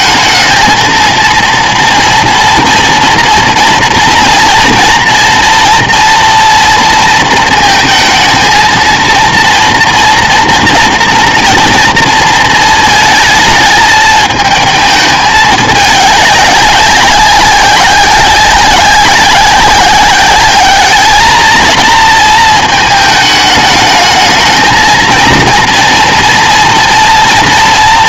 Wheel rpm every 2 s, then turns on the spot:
220, 230, 230, 230, 230, 240, 230, 220, 200, 190, 210, 220, 220, 230.
none